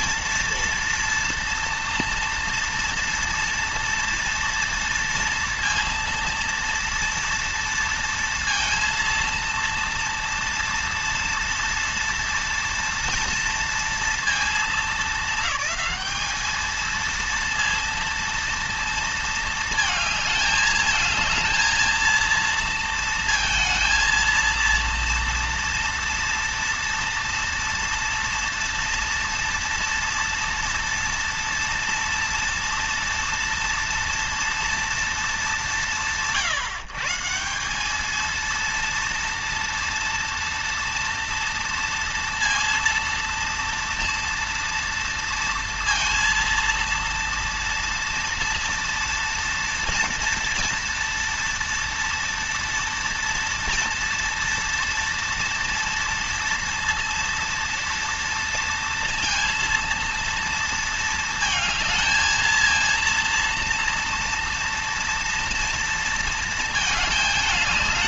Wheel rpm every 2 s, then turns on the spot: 230, 230, 230, 230, 230, 230, 230, 220, 230, 230, 220, 230, 230, 230, 230, 230, 230, 230, 150, 230, 230, 230, 230, 230, 230, 230, 230, 230, 230, 230, 230, 230, 230, 220.
none